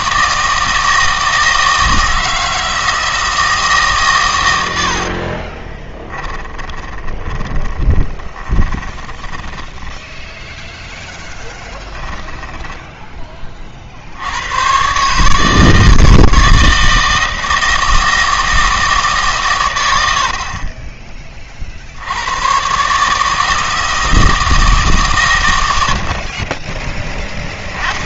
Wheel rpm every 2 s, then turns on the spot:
160, 160, 90, 20, 20, 0, 10, 120, 160, 160, 40, 130, 150, 20.
6-10 12-14